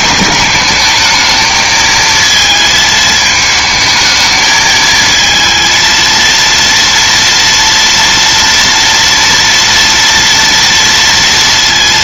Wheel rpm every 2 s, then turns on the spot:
210, 220, 220, 230, 230, 230.
none